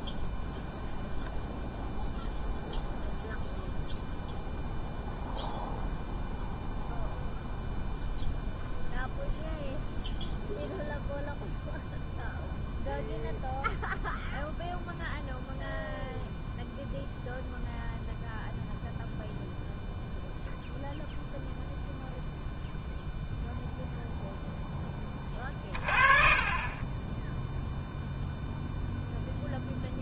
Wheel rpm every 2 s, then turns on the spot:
0, 0, 0, 0, 0, 0, 0, 0, 0, 0, 0, 0, 20, 20, 0.
none